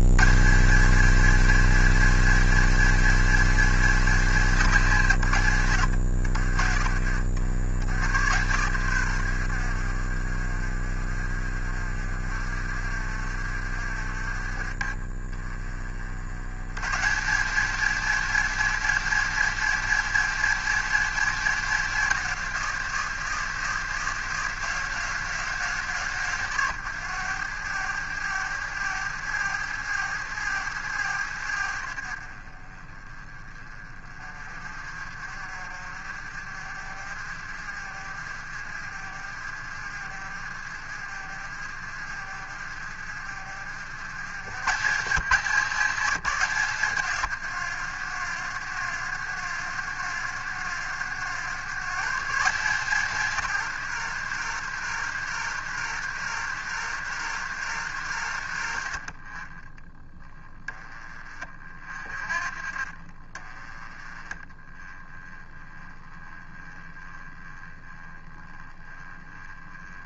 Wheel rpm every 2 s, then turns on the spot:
140, 220, 190, 70, 100, 40, 50, 40, 100, 210, 220, 170, 160, 130, 90, 90, 40, 30, 40, 50, 50, 50, 120, 160, 80, 80, 150, 110, 100, 80, 20, 40, 20, 20, 20.
none